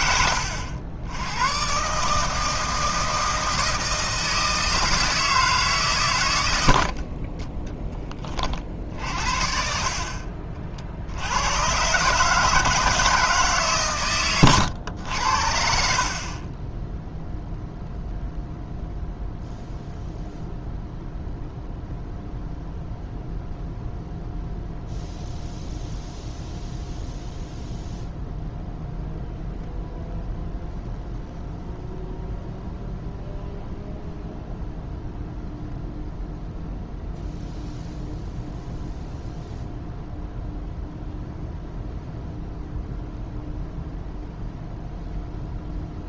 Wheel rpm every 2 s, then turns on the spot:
80, 160, 160, 70, 50, 50, 160, 110, 10, 0, 0, 0, 0, 0, 0, 0, 0, 0, 0, 0, 0, 0, 0.
none